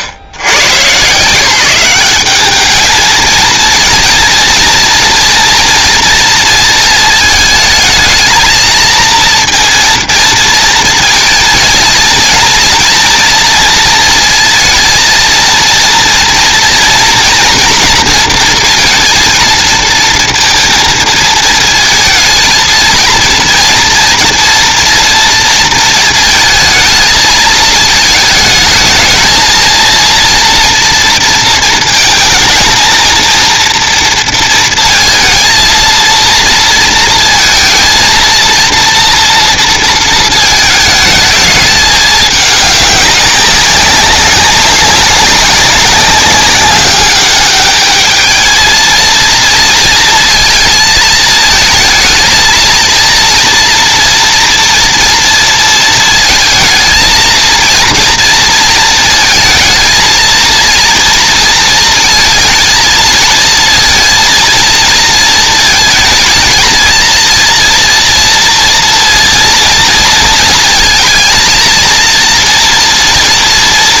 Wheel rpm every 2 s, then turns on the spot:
140, 210, 230, 230, 220, 230, 230, 230, 240, 230, 230, 220, 230, 220, 220, 230, 220, 230, 230, 230, 220, 200, 200, 200, 220, 230, 230, 240, 230, 230, 230, 230, 230, 230, 230, 230, 240.
none